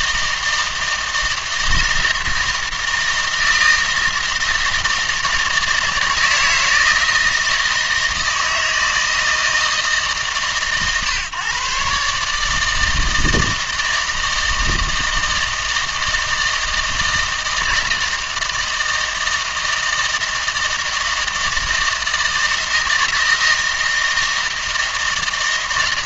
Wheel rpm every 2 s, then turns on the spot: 160, 160, 160, 160, 160, 140, 160, 160, 160, 160, 160, 160, 160.
none